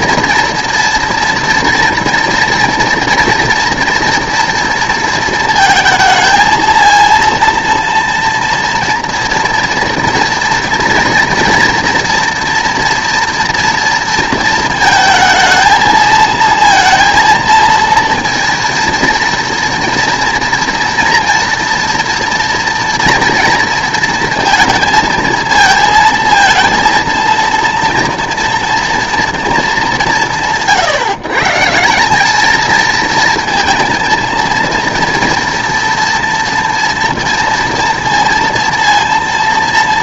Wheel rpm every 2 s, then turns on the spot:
230, 230, 230, 230, 230, 230, 230, 230, 230, 230, 230, 230, 230, 230, 230, 150, 220, 230, 240, 230.
none